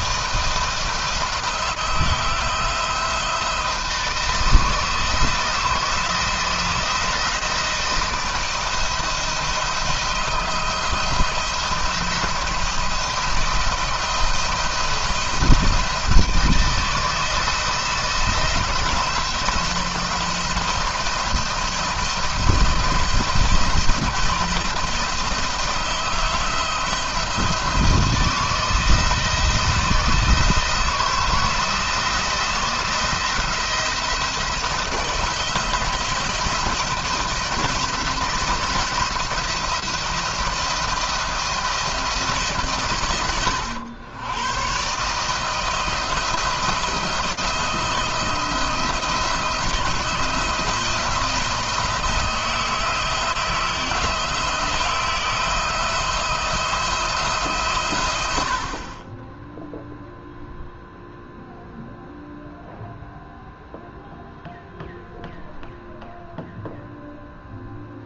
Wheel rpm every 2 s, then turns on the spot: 170, 170, 160, 160, 160, 160, 170, 170, 160, 170, 170, 170, 170, 170, 160, 160, 160, 160, 170, 170, 170, 130, 130, 160, 160, 170, 160, 160, 170, 50, 0, 0, 0, 0.
none